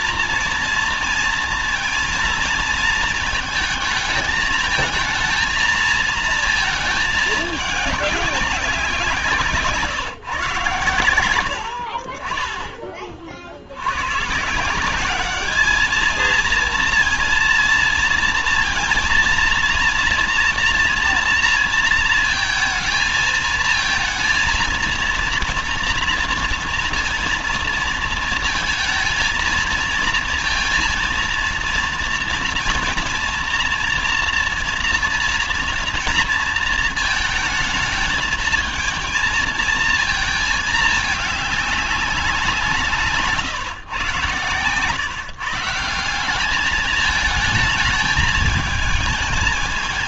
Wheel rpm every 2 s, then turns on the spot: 230, 230, 220, 230, 190, 130, 30, 160, 220, 230, 230, 230, 230, 230, 230, 230, 230, 230, 230, 220, 220, 180, 130, 190, 220.
none